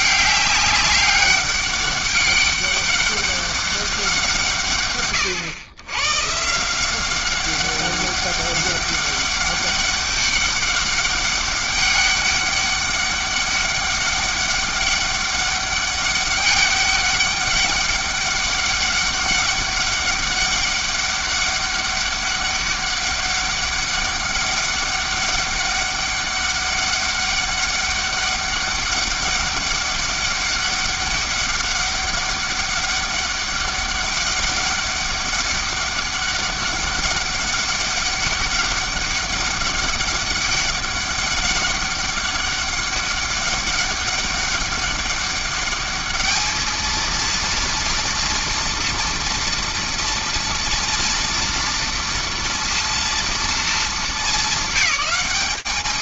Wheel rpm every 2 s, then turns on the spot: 200, 200, 140, 170, 200, 200, 200, 200, 200, 200, 200, 200, 200, 200, 200, 200, 200, 200, 200, 200, 200, 200, 200, 220, 230, 240, 230, 220.
none